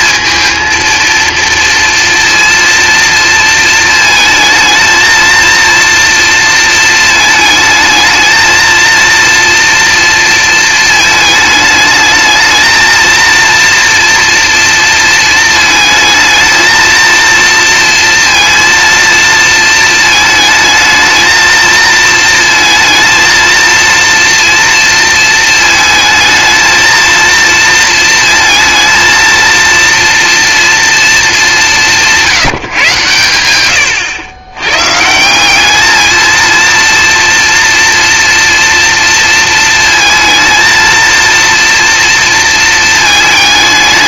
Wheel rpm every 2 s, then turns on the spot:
230, 230, 220, 230, 220, 230, 220, 230, 220, 230, 220, 230, 230, 220, 230, 230, 160, 120, 230, 230, 230, 230.
none